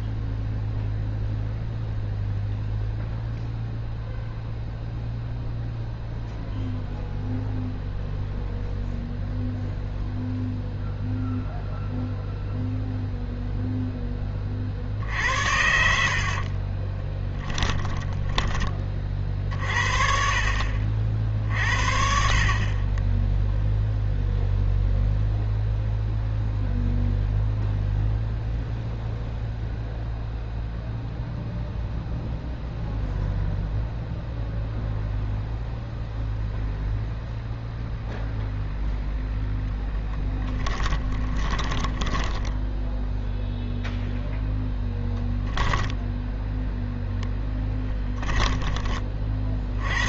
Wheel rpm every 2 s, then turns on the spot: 0, 0, 0, 0, 0, 0, 0, 40, 30, 20, 50, 40, 0, 0, 0, 0, 0, 0, 0, 0, 10, 10, 0, 0, 20.
16-18 40-44 48-50